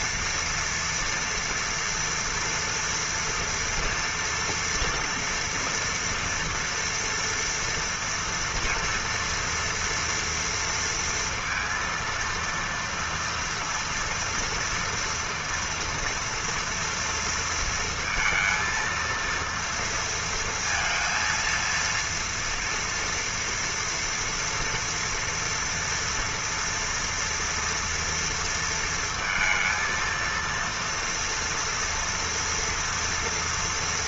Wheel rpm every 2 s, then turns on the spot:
230, 230, 230, 230, 230, 230, 230, 230, 230, 230, 230, 230, 230, 230, 230, 230, 230.
none